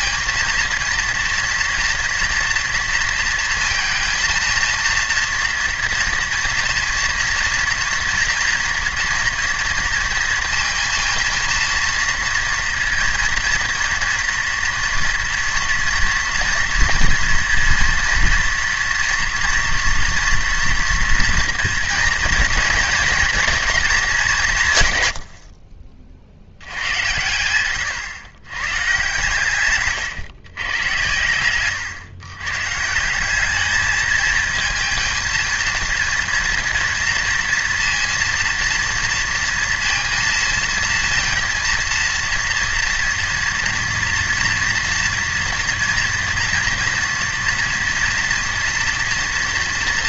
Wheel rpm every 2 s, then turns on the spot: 230, 240, 230, 230, 230, 230, 230, 240, 230, 230, 230, 230, 150, 100, 130, 120, 140, 230, 230, 230, 230, 230, 230, 230, 230.
none